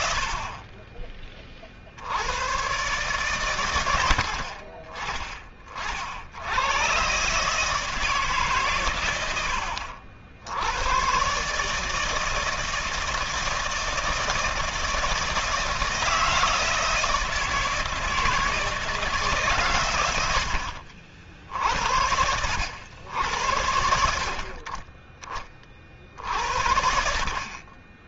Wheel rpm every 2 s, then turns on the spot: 30, 140, 50, 120, 110, 110, 160, 160, 160, 160, 60, 90, 40, 60.
none